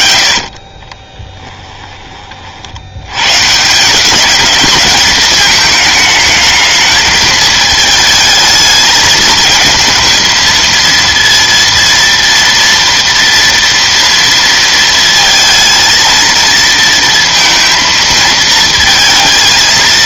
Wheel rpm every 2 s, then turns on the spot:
50, 50, 210, 220, 220, 220, 230, 230, 230, 220.
none